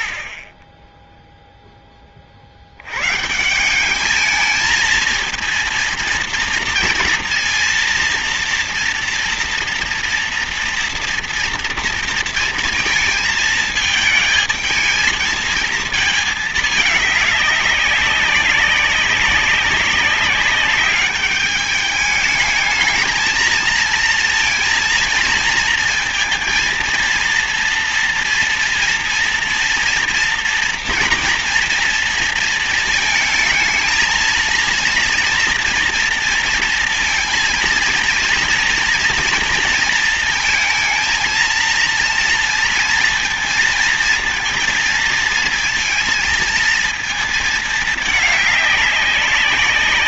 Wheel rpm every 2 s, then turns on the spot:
40, 40, 210, 230, 240, 230, 230, 220, 220, 200, 200, 210, 230, 230, 230, 230, 230, 230, 230, 230, 230, 240, 230, 230, 210.
none